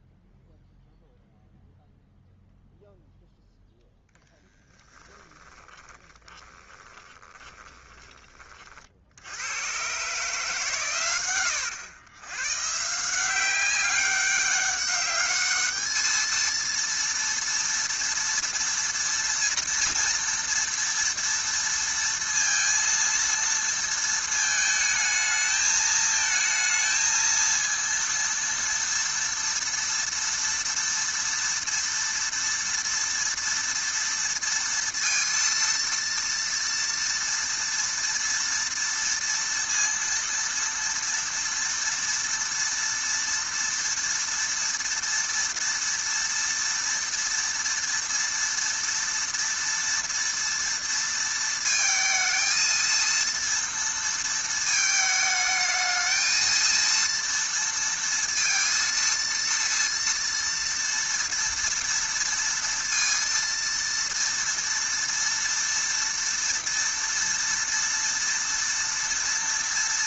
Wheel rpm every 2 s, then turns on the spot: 0, 0, 10, 20, 40, 130, 130, 200, 230, 230, 230, 230, 220, 220, 230, 230, 230, 230, 230, 230, 230, 230, 230, 230, 230, 230, 230, 220, 230, 230, 230, 230, 230, 230, 230.
4-8